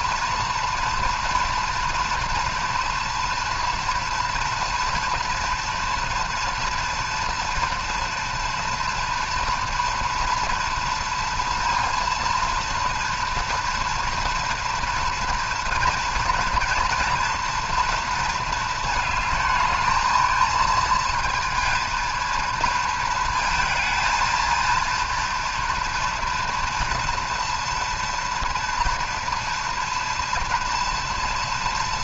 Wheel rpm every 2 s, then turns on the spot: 230, 230, 230, 230, 230, 230, 230, 230, 230, 220, 230, 230, 230, 230, 230, 230.
none